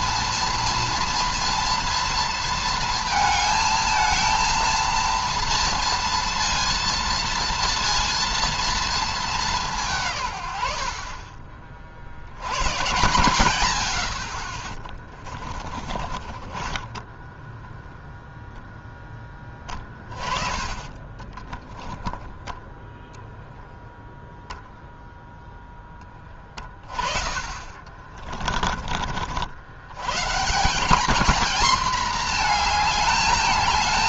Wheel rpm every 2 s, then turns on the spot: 230, 230, 230, 230, 230, 100, 100, 40, 30, 0, 30, 0, 0, 30, 40, 190, 220.
14-18 20-22 26-28